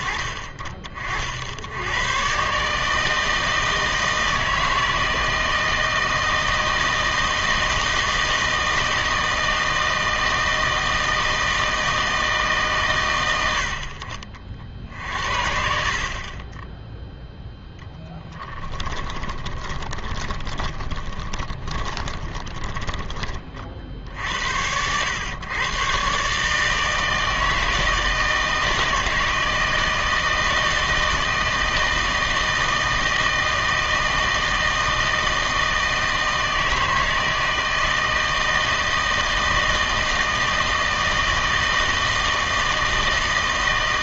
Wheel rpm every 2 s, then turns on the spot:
40, 150, 160, 160, 160, 160, 130, 50, 10, 10, 20, 20, 80, 150, 160, 160, 160, 160, 160, 160, 160, 160.
18-24